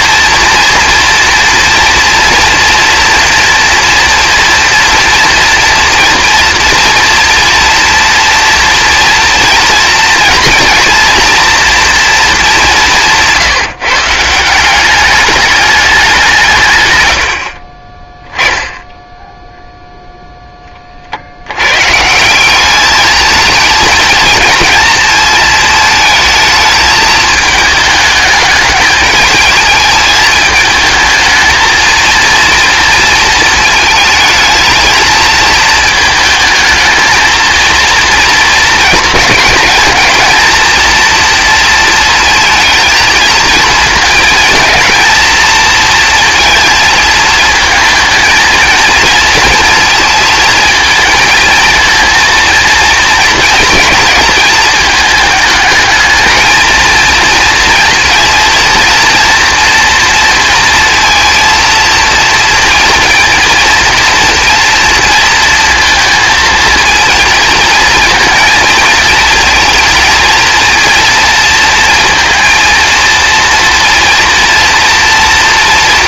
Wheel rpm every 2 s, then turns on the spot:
230, 240, 230, 240, 230, 230, 190, 190, 120, 10, 30, 200, 220, 220, 210, 220, 230, 220, 220, 220, 230, 230, 220, 220, 230, 230, 240, 220, 220, 230, 230, 230, 230, 230, 220, 230, 230, 230.
none